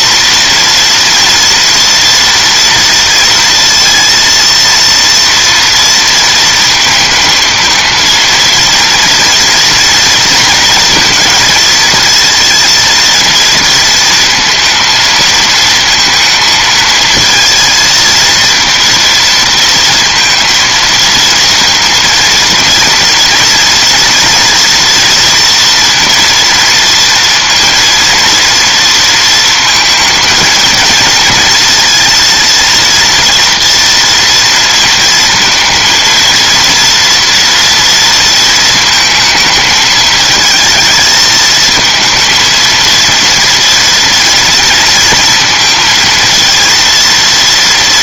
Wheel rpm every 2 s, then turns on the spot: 230, 230, 230, 230, 230, 230, 230, 230, 230, 230, 230, 230, 230, 230, 230, 220, 230, 230, 230, 230, 220, 230, 230, 230.
none